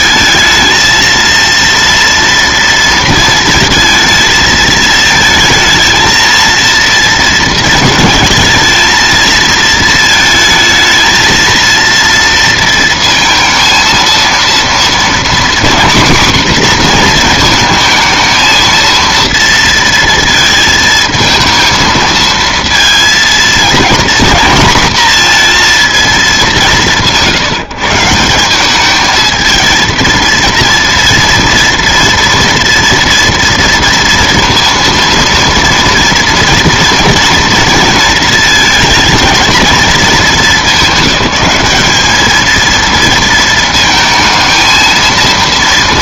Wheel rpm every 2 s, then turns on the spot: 220, 230, 220, 230, 220, 220, 230, 230, 250, 230, 230, 230, 230, 180, 190, 230, 230, 230, 230, 220, 210, 230, 230.
none